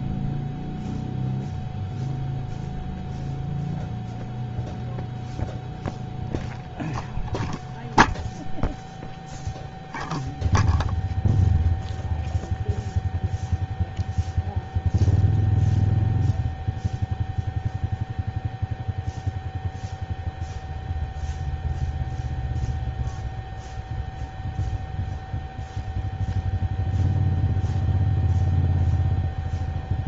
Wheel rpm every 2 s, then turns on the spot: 0, 0, 0, 0, 0, 0, 0, 0, 0, 0, 0, 0, 0, 0, 0.
none